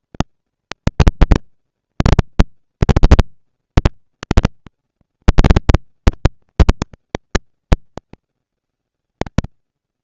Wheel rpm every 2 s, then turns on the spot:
230, 230, 220, 200, 150.
none